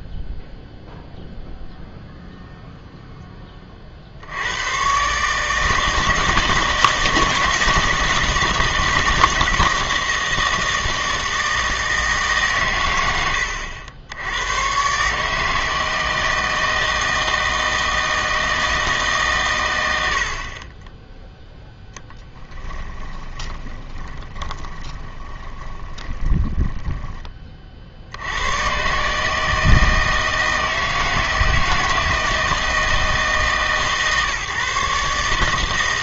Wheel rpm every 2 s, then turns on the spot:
0, 0, 110, 160, 160, 160, 120, 120, 160, 160, 20, 20, 20, 20, 120, 160, 160, 140.
22-28